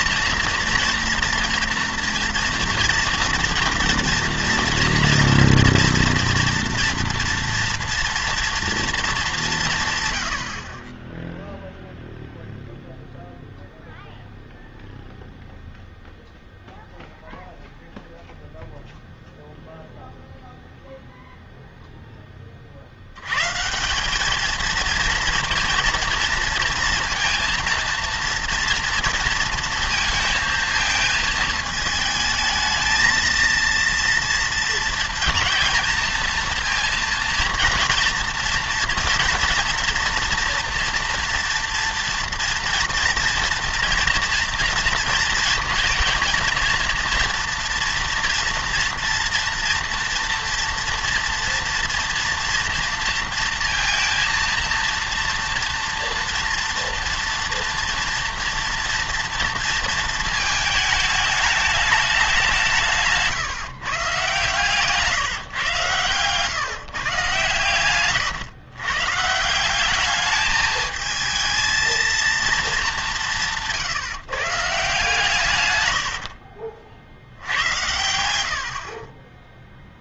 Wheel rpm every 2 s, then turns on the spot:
240, 230, 240, 230, 230, 60, 0, 0, 0, 0, 0, 40, 220, 230, 230, 230, 220, 230, 230, 230, 240, 230, 230, 230, 230, 230, 240, 230, 240, 230, 220, 180, 150, 130, 130, 220, 220, 150, 50, 70.
76-78